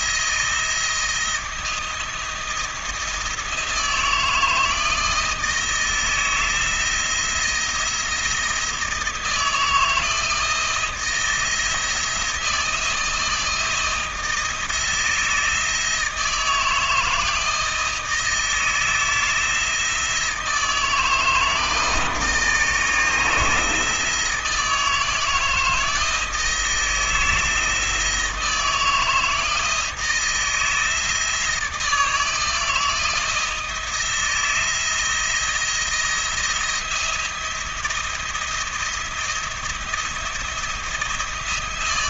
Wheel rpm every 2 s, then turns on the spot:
170, 170, 160, 160, 170, 160, 170, 160, 160, 160, 160, 160, 160, 160, 160, 160, 160, 170, 170, 170, 170.
none